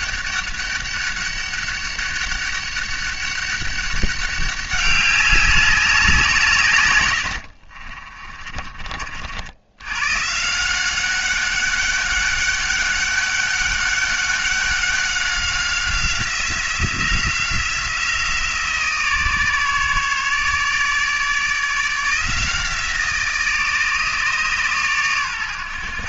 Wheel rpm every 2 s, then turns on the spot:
200, 200, 200, 140, 40, 180, 200, 190, 180, 160, 150, 160, 140.
none